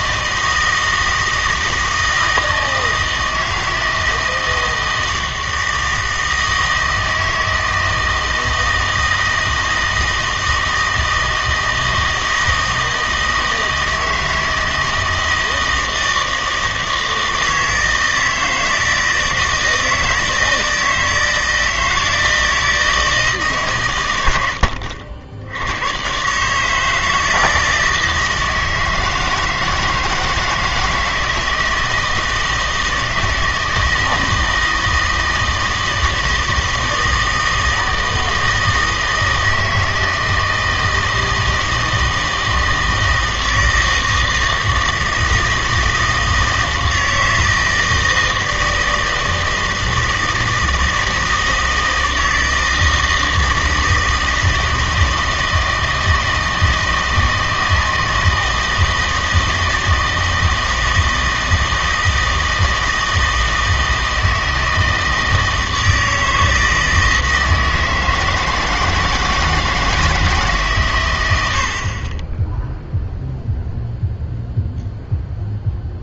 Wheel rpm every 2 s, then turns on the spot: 160, 160, 160, 160, 160, 160, 160, 160, 160, 160, 160, 160, 90, 150, 160, 160, 160, 160, 160, 160, 160, 160, 160, 160, 160, 160, 160, 160, 160, 160, 160, 160, 160, 160, 160, 140, 10, 0.
none